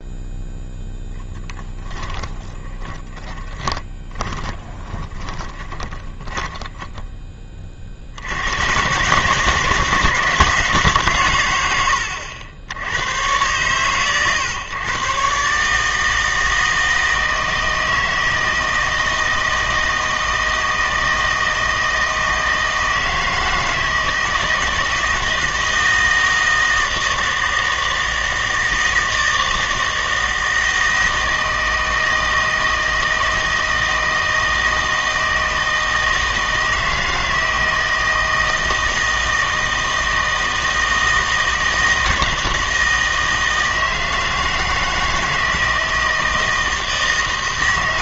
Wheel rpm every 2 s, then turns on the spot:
0, 20, 20, 10, 110, 160, 70, 120, 160, 160, 160, 160, 160, 160, 160, 160, 160, 160, 160, 160, 160, 160, 160, 160.
2-8